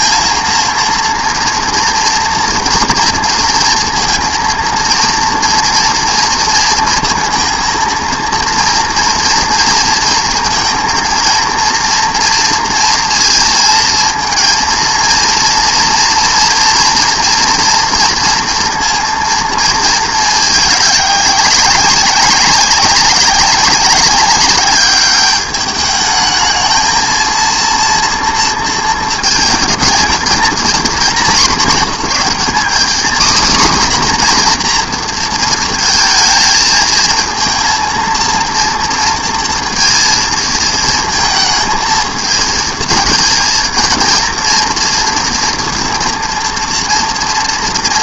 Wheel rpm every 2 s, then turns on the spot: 230, 230, 230, 230, 230, 230, 230, 230, 240, 230, 210, 190, 200, 220, 220, 220, 240, 240, 220, 230, 230, 230, 240, 230.
none